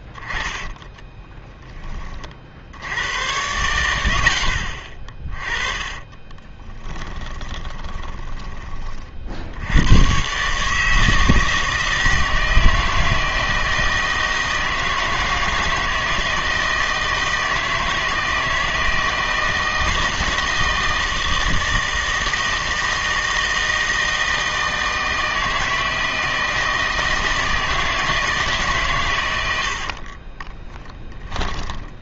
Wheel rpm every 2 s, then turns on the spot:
20, 70, 50, 20, 20, 150, 160, 160, 160, 160, 160, 160, 160, 160, 150, 10.
0-2 6-8 30-32